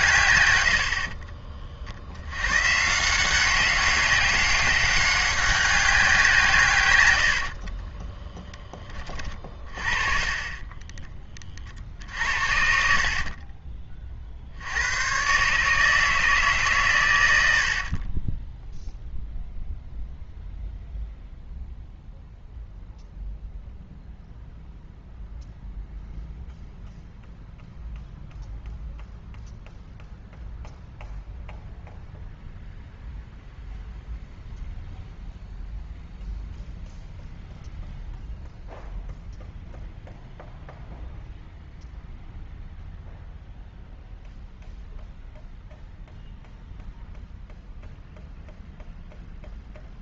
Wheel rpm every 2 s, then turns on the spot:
90, 130, 200, 140, 20, 20, 60, 70, 140, 10, 0, 0, 0, 0, 0, 0, 0, 0, 0, 0, 0, 0, 0, 0, 0.
12-14